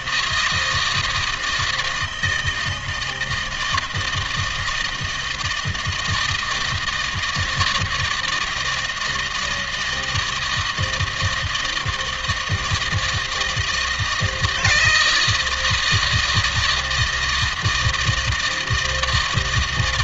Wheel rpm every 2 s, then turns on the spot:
160, 160, 160, 160, 170, 160, 160, 160, 160, 160.
none